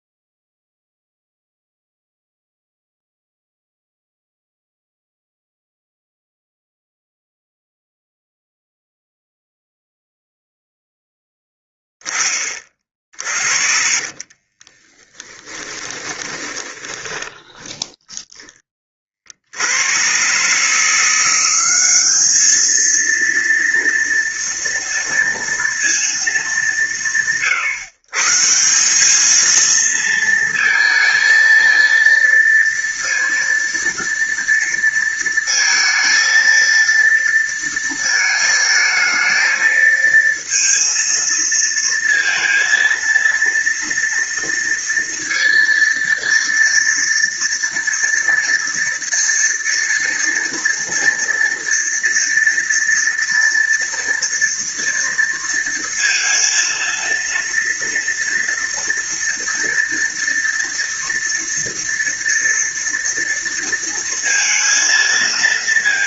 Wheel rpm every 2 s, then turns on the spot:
0, 0, 0, 0, 0, 0, 30, 30, 20, 30, 150, 220, 230, 140, 180, 230, 230, 230, 230, 220, 230, 230, 230, 230, 230, 230, 230, 230, 230, 240, 230, 230, 230.
14-18